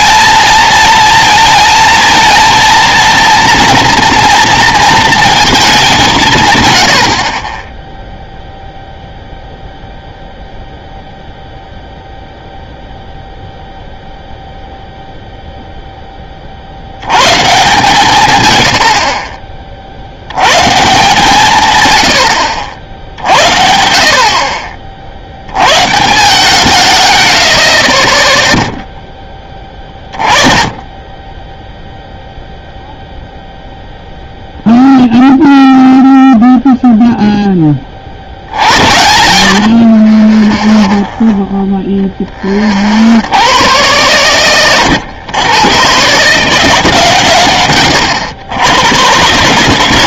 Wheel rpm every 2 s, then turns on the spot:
230, 230, 230, 120, 0, 0, 0, 0, 70, 90, 140, 70, 40, 130, 0, 20, 0, 0, 0, 90, 20, 40, 110, 150, 100.
40-42 44-46